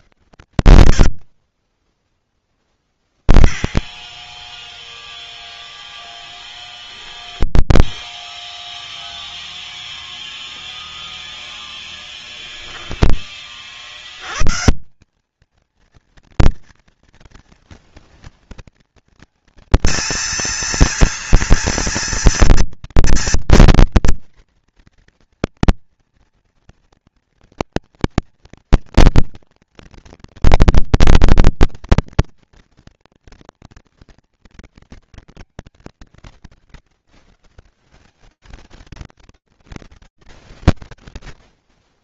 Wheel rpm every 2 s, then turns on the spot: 0, 0, 0, 0, 0, 0, 120, 230, 230, 230, 230, 240, 240, 230, 230, 230, 220, 150, 160, 120, 10.
none